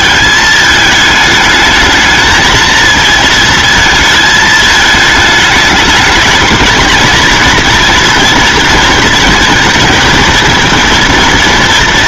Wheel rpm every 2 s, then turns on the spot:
220, 230, 220, 220, 220, 220.
none